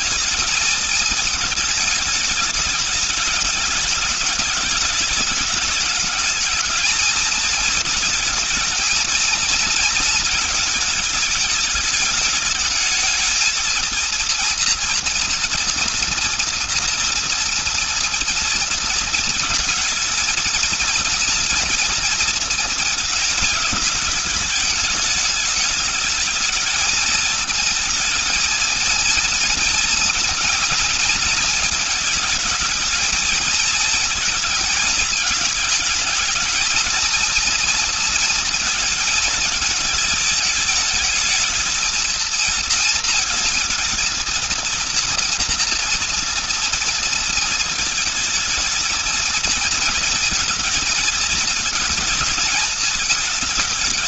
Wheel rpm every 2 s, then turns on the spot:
210, 210, 210, 220, 230, 220, 220, 230, 230, 230, 230, 220, 210, 210, 230, 230, 220, 220, 230, 230, 220, 230, 230, 230, 220, 220, 220.
none